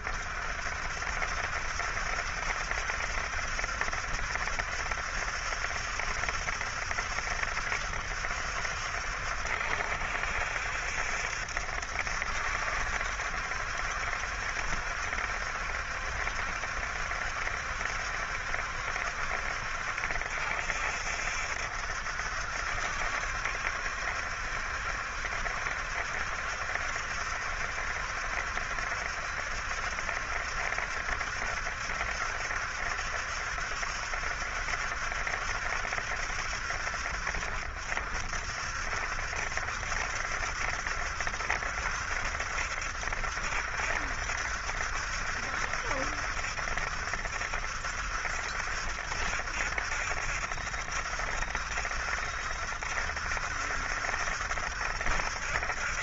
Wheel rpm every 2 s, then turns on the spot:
60, 70, 70, 70, 70, 70, 70, 70, 70, 70, 70, 70, 70, 70, 70, 70, 70, 70, 60, 60, 70, 70, 70, 70, 70, 70, 70, 70.
none